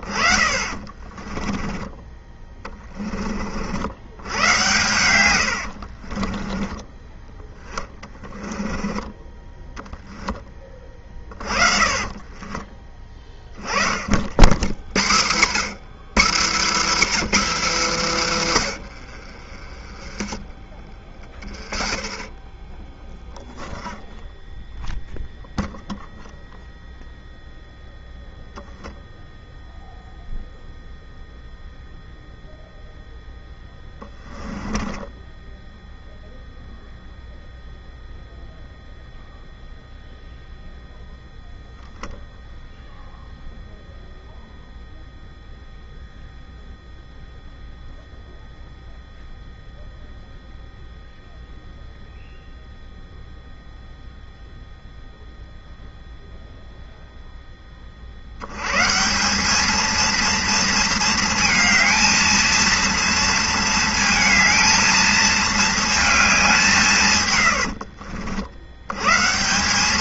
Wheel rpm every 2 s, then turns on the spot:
30, 20, 100, 20, 10, 20, 20, 80, 240, 170, 30, 30, 0, 0, 0, 0, 0, 10, 0, 0, 0, 0, 0, 0, 0, 0, 0, 0, 0, 110, 230, 230, 220, 190, 70.
0-2 8-14 34-36